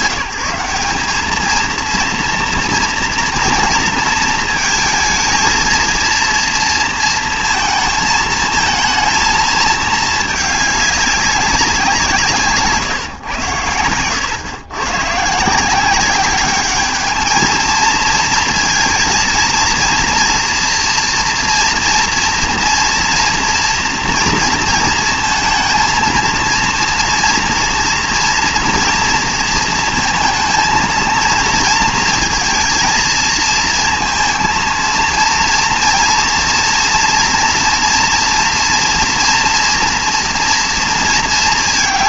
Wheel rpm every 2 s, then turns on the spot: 190, 230, 230, 230, 220, 210, 140, 110, 210, 230, 230, 230, 230, 230, 240, 230, 230, 230, 230, 230, 230.
none